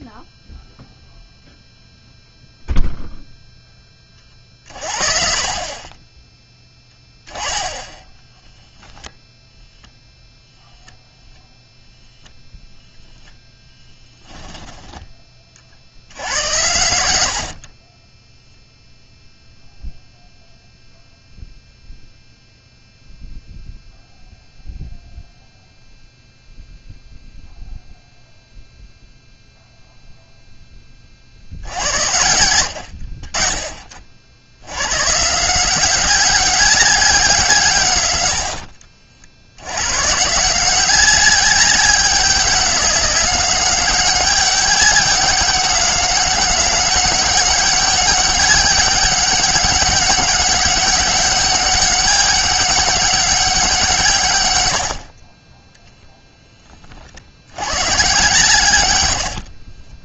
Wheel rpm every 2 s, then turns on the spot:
0, 0, 50, 10, 0, 0, 0, 10, 90, 0, 0, 0, 0, 0, 0, 20, 80, 100, 200, 50, 180, 200, 190, 200, 200, 200, 190, 80, 20, 100.
14-18 38-40 54-56 58-60